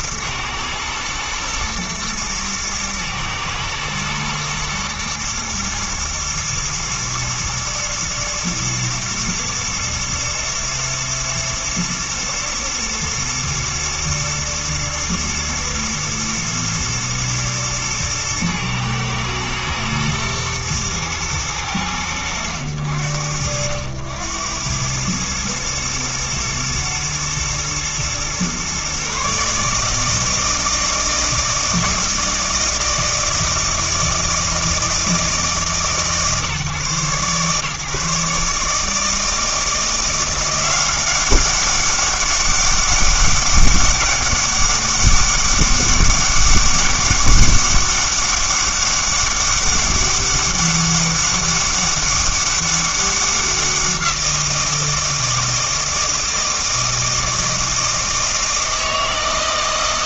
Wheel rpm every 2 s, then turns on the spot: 110, 110, 110, 110, 110, 110, 110, 110, 110, 110, 110, 80, 90, 120, 130, 160, 160, 160, 140, 150, 180, 200, 200, 200, 200, 200, 200, 170, 160, 160.
none